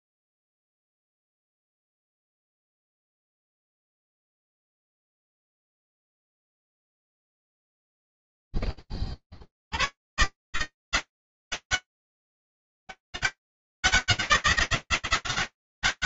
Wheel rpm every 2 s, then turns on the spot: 90, 150, 180, 80, 0, 150, 190, 180.
none